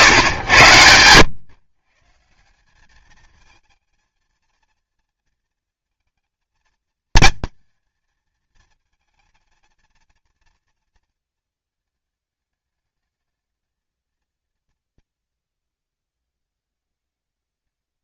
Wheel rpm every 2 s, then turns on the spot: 110, 190, 230, 220, 220, 230, 210, 230, 210.
none